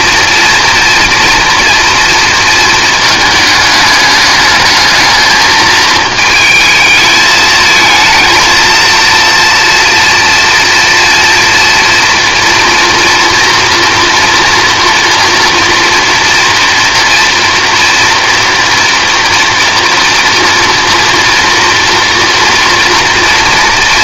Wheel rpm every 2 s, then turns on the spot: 230, 220, 210, 220, 230, 230, 230, 240, 240, 240, 230, 240.
none